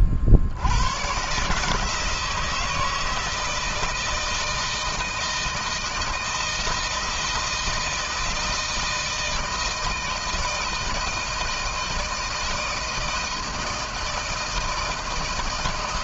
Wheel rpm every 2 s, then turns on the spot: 70, 160, 160, 160, 160, 160, 160, 160.
none